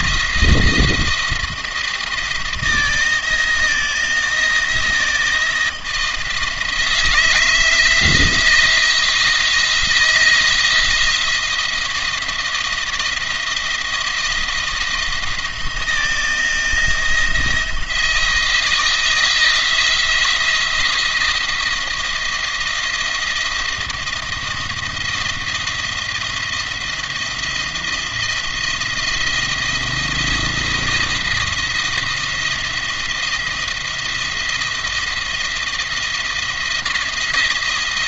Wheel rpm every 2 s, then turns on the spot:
170, 170, 170, 160, 170, 170, 170, 170, 170, 160, 170, 170, 170, 170, 170, 170, 170, 170, 160.
none